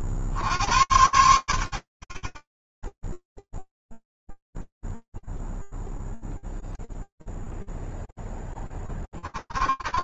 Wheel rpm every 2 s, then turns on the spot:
90, 40, 0, 0, 10.
none